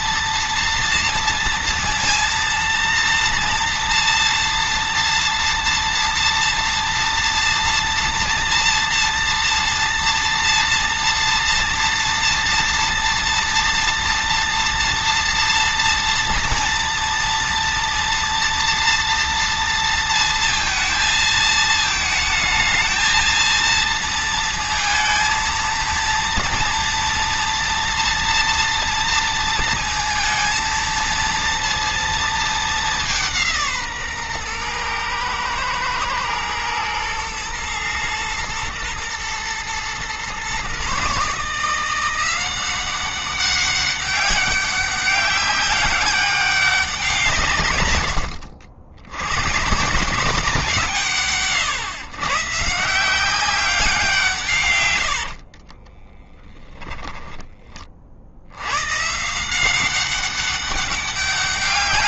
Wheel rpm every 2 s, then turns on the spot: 230, 230, 230, 230, 230, 230, 230, 230, 230, 230, 220, 220, 230, 240, 230, 230, 200, 120, 110, 120, 140, 190, 190, 180, 90, 160, 160, 110, 20, 120, 200.
54-58